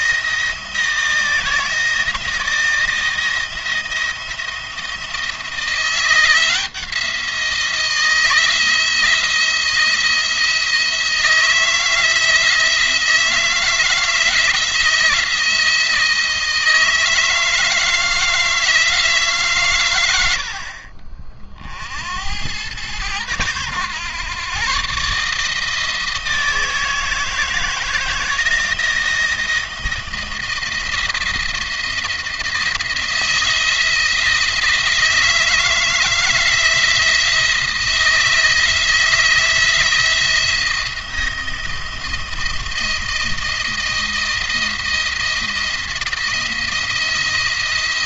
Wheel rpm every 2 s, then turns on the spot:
160, 170, 160, 170, 170, 170, 160, 170, 160, 160, 60, 100, 130, 160, 160, 170, 160, 160, 160, 170, 170, 160, 170, 170.
none